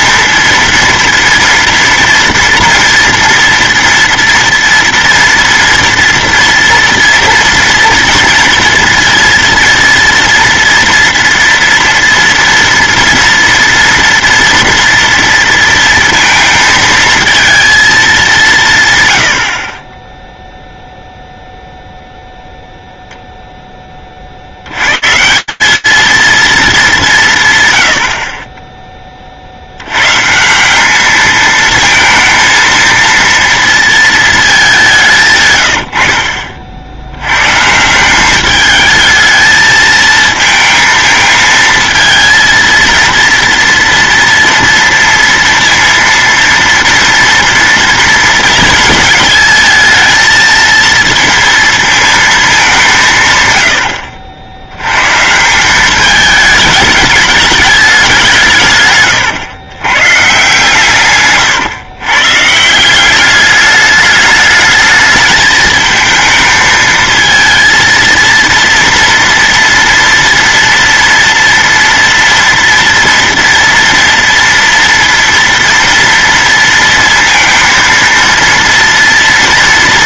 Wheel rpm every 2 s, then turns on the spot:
230, 230, 230, 240, 230, 230, 230, 240, 230, 160, 0, 0, 120, 210, 10, 190, 230, 200, 70, 210, 220, 230, 230, 230, 230, 230, 180, 120, 210, 130, 150, 180, 220, 220, 230, 230, 230, 230, 230, 230.
none